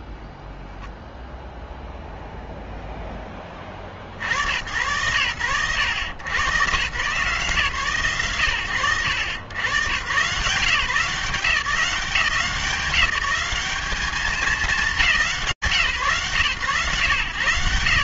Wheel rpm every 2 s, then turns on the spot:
0, 20, 110, 130, 100, 160, 180, 180, 120.
none